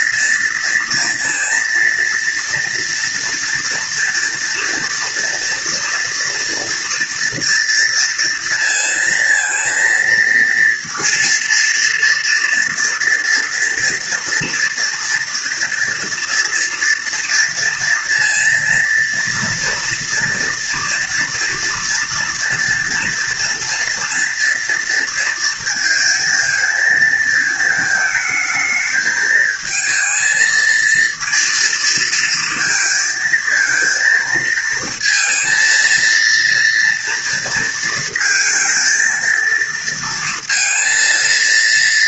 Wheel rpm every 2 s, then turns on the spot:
230, 230, 230, 230, 230, 230, 230, 230, 230, 230, 230, 230, 230, 230, 220, 230, 230, 220, 230, 230, 230.
none